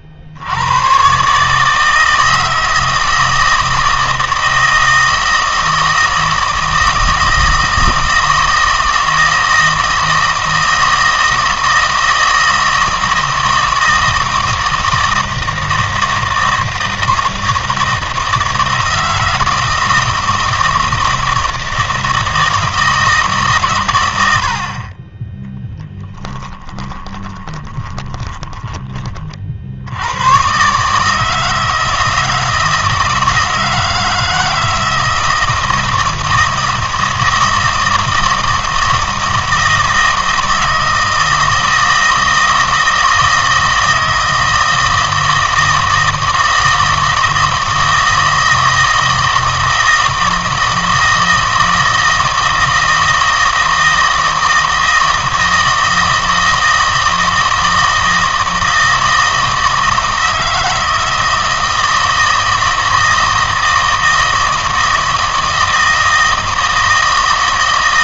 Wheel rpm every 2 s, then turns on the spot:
70, 160, 160, 160, 160, 160, 160, 160, 160, 160, 160, 160, 40, 20, 20, 140, 160, 160, 160, 160, 160, 160, 160, 160, 160, 160, 160, 160, 160, 160, 160, 160, 160, 160.
26-28